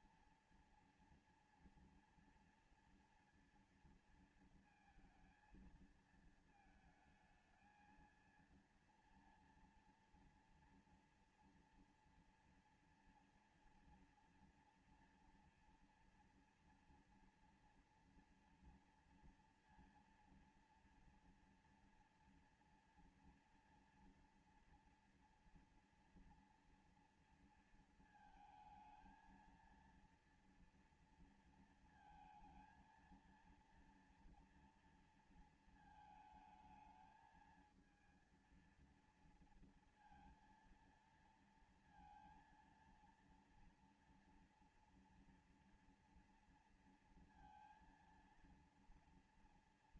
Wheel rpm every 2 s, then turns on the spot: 230, 230, 230, 220, 230, 230, 230, 230, 240, 230, 230, 230, 230, 230, 220, 230, 230, 230, 220, 230, 230, 230, 230, 230, 230.
none